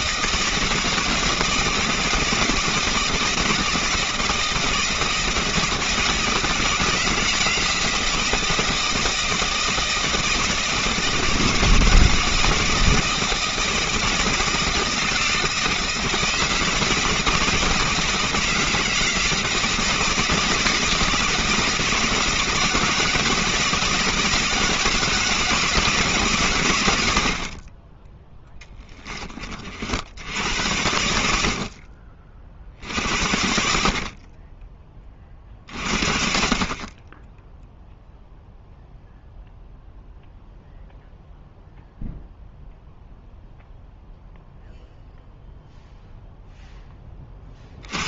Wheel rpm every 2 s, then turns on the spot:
160, 160, 160, 160, 160, 160, 160, 160, 160, 160, 160, 160, 160, 110, 20, 90, 60, 20, 40, 0, 0, 0, 0, 10.
28-30